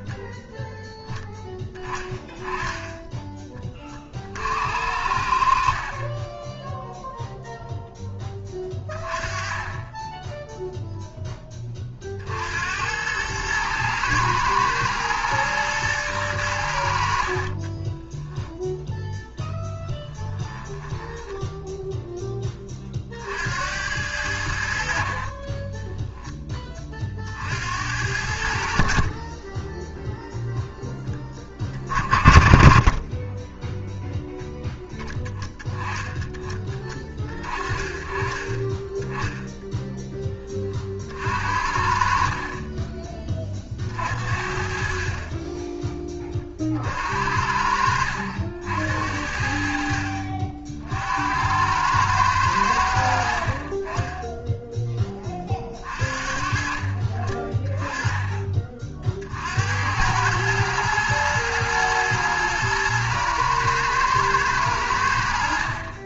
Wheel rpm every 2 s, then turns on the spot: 10, 10, 60, 10, 20, 0, 80, 110, 90, 0, 10, 30, 70, 20, 60, 0, 30, 0, 20, 20, 30, 30, 50, 40, 70, 60, 90, 10, 40, 30, 110, 110, 100.
20-22 32-34 42-44